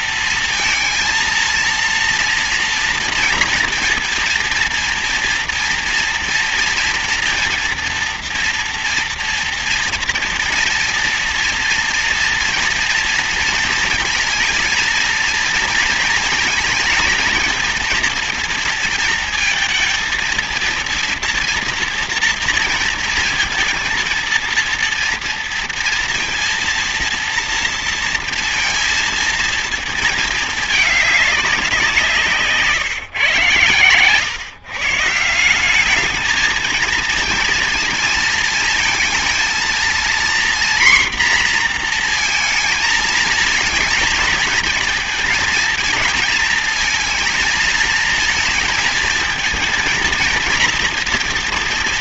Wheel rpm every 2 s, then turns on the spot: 230, 230, 230, 230, 230, 230, 230, 230, 230, 230, 230, 230, 230, 230, 230, 210, 140, 140, 220, 230, 240, 230, 230, 220, 230, 230.
none